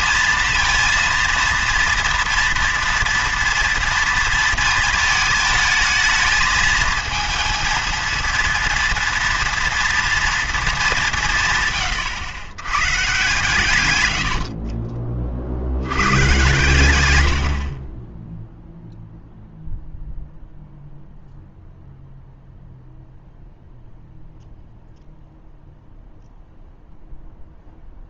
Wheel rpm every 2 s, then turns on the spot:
230, 230, 230, 220, 230, 220, 110, 50, 120, 0, 0, 0, 0, 0.
14-16